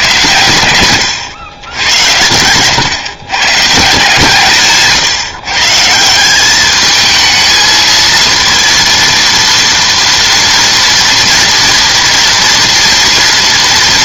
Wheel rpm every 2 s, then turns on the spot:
120, 120, 140, 210, 230, 230, 230.
none